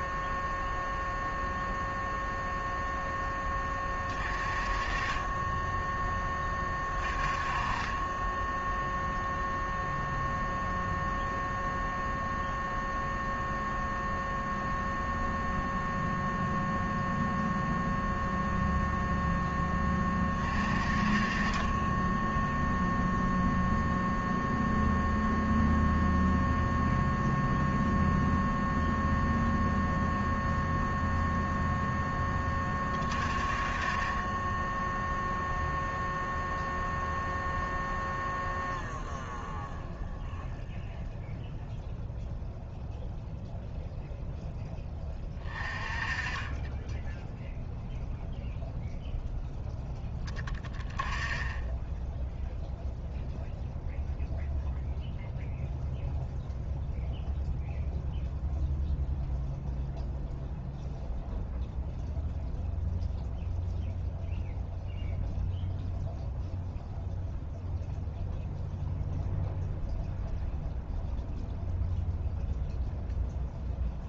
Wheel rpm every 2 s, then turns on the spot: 0, 0, 30, 30, 0, 0, 0, 0, 0, 0, 30, 0, 0, 0, 0, 0, 30, 10, 0, 0, 0, 0, 10, 10, 0, 10, 0, 0, 0, 0, 0, 0, 0, 0, 0, 0, 0.
none